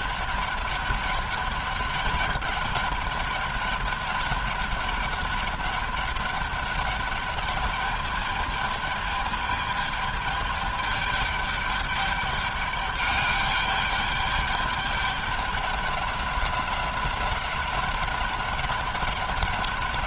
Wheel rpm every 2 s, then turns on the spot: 200, 200, 200, 200, 210, 210, 210, 200, 200, 200.
none